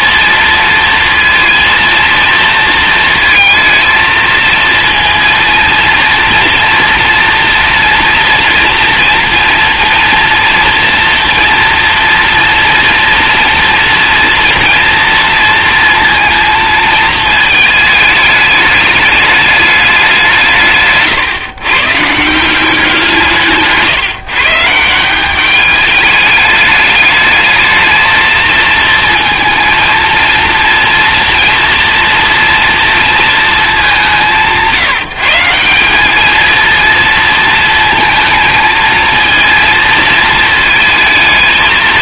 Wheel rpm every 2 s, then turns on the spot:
230, 230, 230, 230, 240, 240, 230, 230, 230, 210, 150, 180, 160, 210, 230, 240, 230, 170, 230, 220, 220.
none